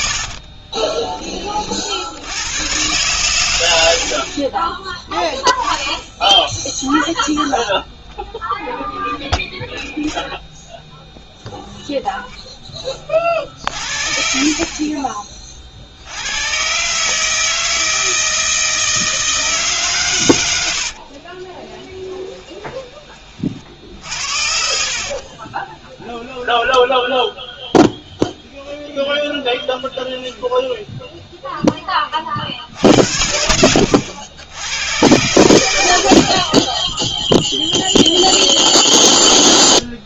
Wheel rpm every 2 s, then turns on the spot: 50, 100, 20, 0, 0, 0, 10, 40, 110, 160, 90, 20, 50, 10, 0, 10, 60, 90, 30, 0.
0-2 22-28